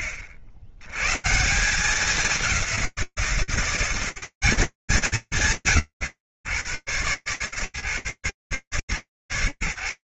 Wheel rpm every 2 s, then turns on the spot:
100, 180, 180, 110, 140.
none